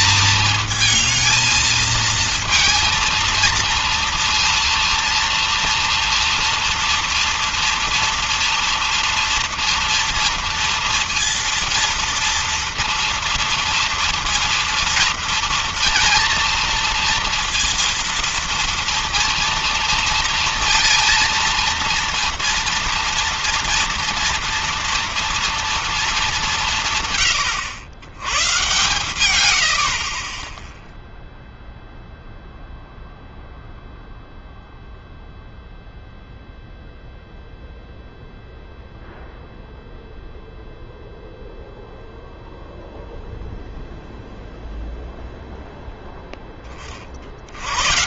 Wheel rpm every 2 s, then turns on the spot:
220, 230, 230, 230, 230, 230, 230, 230, 230, 230, 230, 230, 240, 190, 110, 20, 0, 0, 0, 0, 0, 0, 0, 20.
30-32